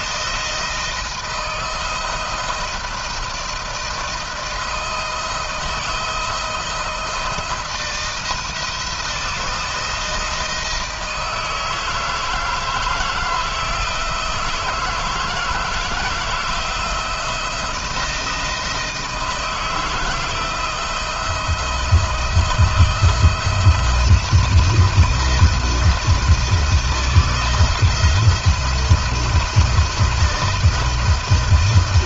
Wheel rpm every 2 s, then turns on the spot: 160, 160, 160, 170, 170, 160, 160, 160, 170, 160, 170, 160, 170, 170, 170, 160.
none